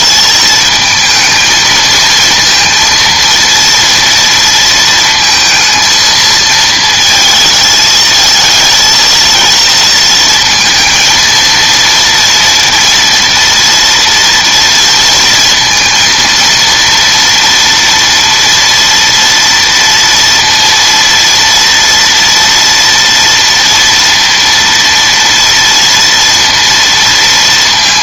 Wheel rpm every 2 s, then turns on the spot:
220, 230, 230, 220, 230, 220, 230, 230, 230, 230, 230, 230, 230, 230.
none